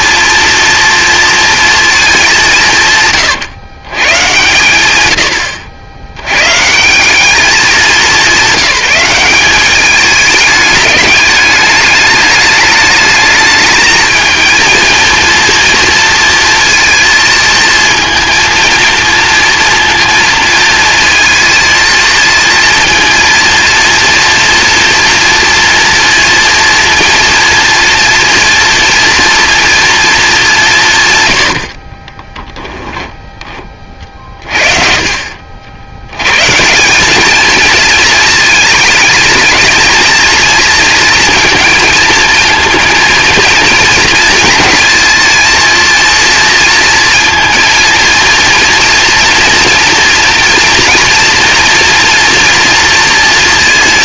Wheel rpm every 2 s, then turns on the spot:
240, 150, 100, 150, 200, 210, 210, 230, 230, 230, 230, 230, 230, 240, 230, 190, 10, 40, 180, 220, 230, 230, 220, 230, 230, 230, 240.
32-34